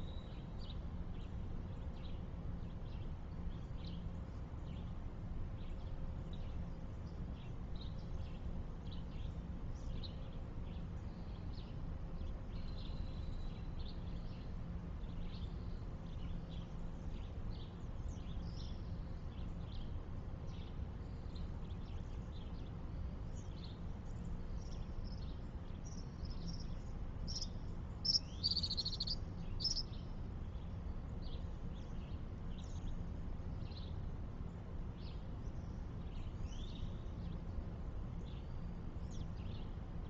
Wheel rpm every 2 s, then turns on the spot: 0, 0, 0, 0, 0, 0, 0, 0, 0, 0, 0, 0, 0, 0, 0, 0, 0, 0, 0, 0.
none